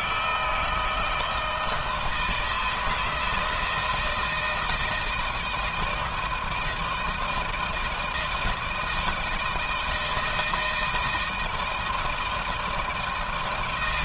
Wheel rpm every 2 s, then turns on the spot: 160, 160, 160, 160, 160, 170, 160.
none